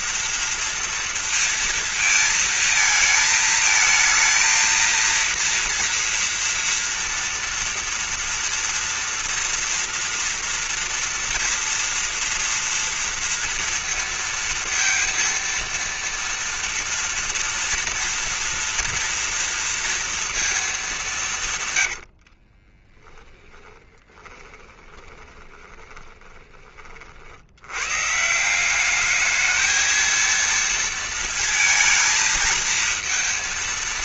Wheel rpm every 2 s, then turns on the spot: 230, 230, 220, 230, 230, 230, 230, 230, 230, 230, 230, 80, 20, 30, 150, 230, 220.
22-28